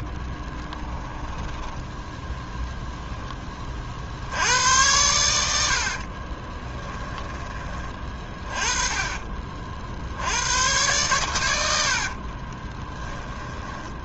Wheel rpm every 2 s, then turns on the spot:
20, 0, 100, 20, 20, 100, 20.
0-2 6-10 12-14